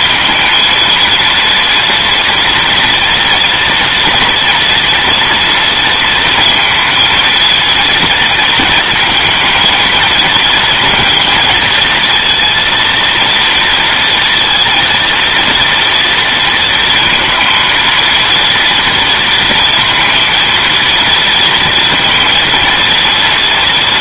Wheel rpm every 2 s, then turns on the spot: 230, 230, 230, 230, 220, 220, 230, 230, 230, 230, 230, 230.
none